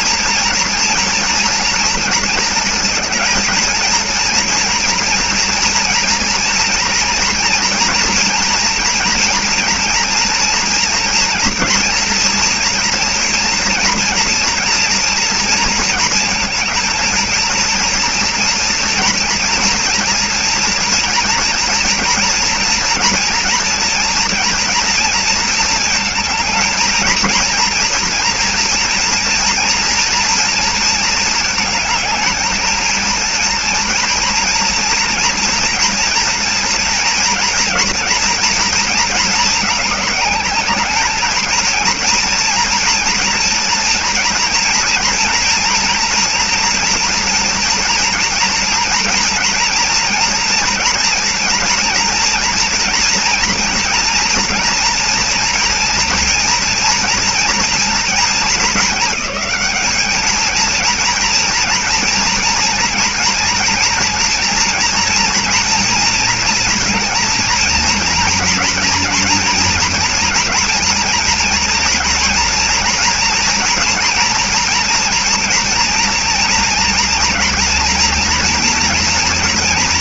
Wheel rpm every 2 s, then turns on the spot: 230, 230, 230, 230, 230, 230, 230, 230, 230, 230, 230, 230, 230, 220, 230, 230, 220, 230, 230, 230, 210, 230, 230, 240, 230, 230, 240, 240, 230, 220, 220, 230, 240, 230, 230, 230, 230, 230, 230, 230.
none